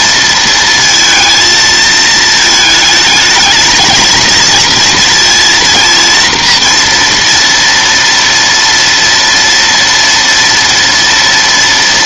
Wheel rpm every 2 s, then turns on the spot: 230, 220, 220, 230, 230, 230.
none